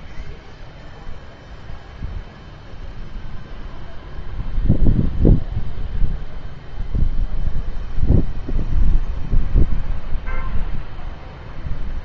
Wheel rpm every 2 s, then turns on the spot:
0, 0, 0, 0, 0, 0.
none